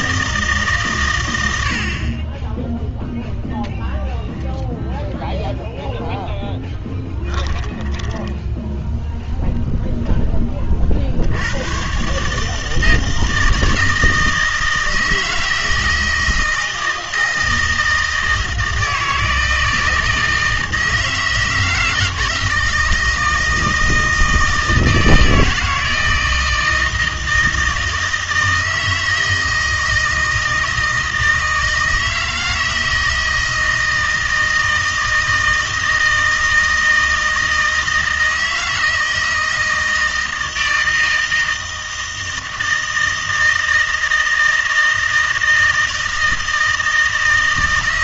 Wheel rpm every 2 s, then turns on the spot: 140, 10, 10, 10, 10, 30, 160, 160, 160, 160, 160, 160, 160, 160, 160, 160, 160, 160, 160, 160, 160, 160, 160, 160.
6-8